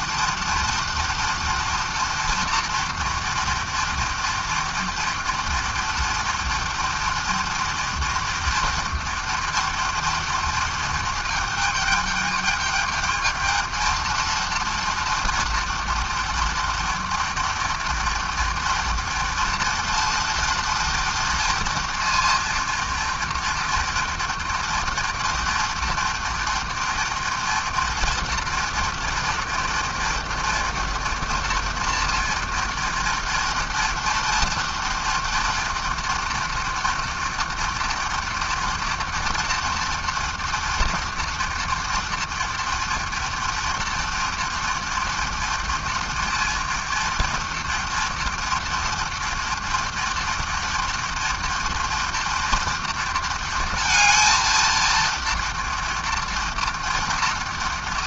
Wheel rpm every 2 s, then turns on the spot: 230, 230, 230, 230, 230, 230, 210, 230, 230, 230, 230, 230, 230, 230, 230, 230, 230, 230, 240, 230, 230, 230, 230, 240, 240, 230, 230, 230, 230.
none